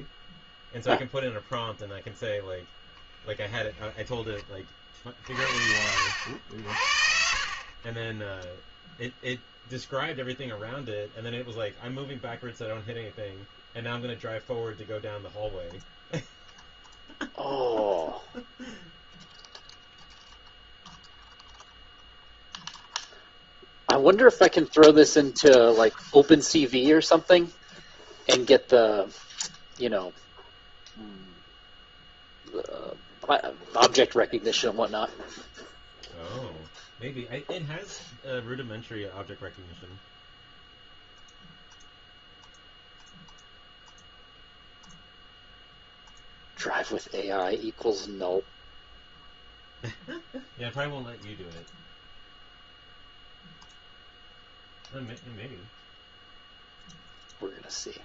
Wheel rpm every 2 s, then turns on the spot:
0, 10, 30, 70, 0, 0, 0, 0, 0, 0, 0, 0, 0, 0, 0, 0, 0, 0, 0, 0, 0, 0, 0, 0, 0, 0, 0, 0, 0.
none